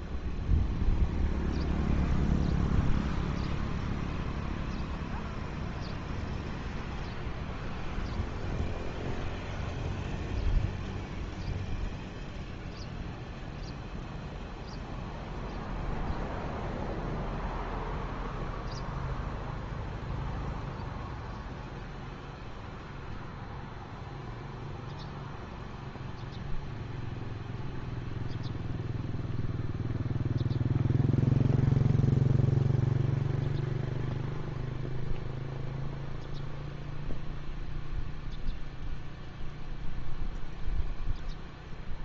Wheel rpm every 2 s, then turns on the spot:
0, 0, 0, 0, 0, 0, 0, 0, 0, 0, 0, 0, 0, 0, 0, 0, 0, 0, 0, 0, 0.
none